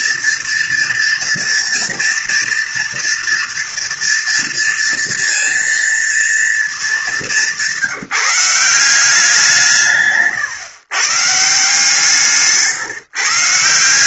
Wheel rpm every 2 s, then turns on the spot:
230, 230, 230, 210, 180, 140, 150.
none